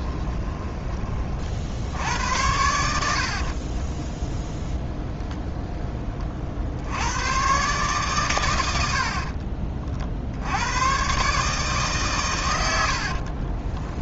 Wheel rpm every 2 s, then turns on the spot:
20, 70, 0, 80, 70, 110, 80.
2-4 12-14